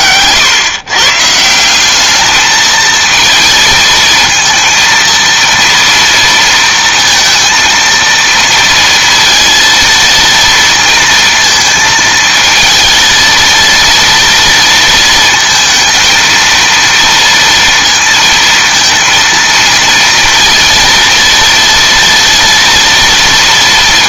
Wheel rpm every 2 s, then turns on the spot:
130, 210, 230, 230, 230, 230, 230, 230, 220, 230, 230, 230.
none